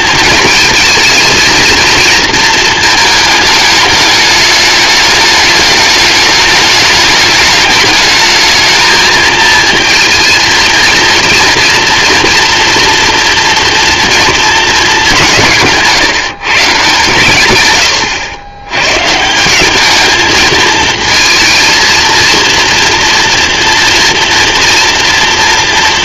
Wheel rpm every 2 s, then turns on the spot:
220, 230, 210, 210, 220, 230, 240, 220, 150, 110, 220, 230, 230.
none